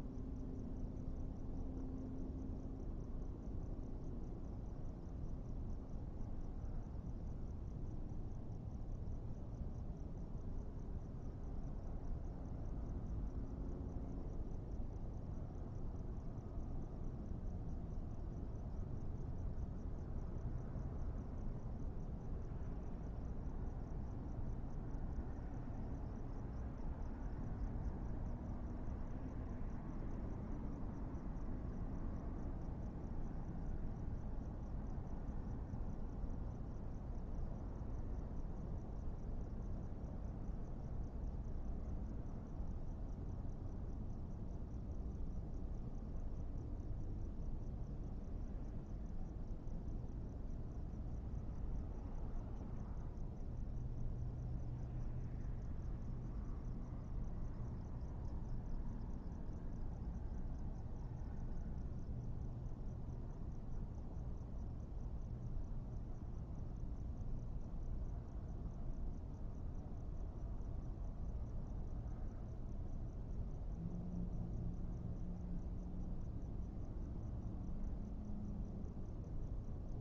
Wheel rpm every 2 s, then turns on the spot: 0, 0, 0, 0, 0, 0, 0, 0, 0, 0, 0, 0, 0, 0, 0, 0, 0, 0, 0, 0, 0, 0, 0, 0, 0, 0, 0, 0, 0, 0, 0, 0, 0, 0, 0, 0, 0, 0, 0, 0.
none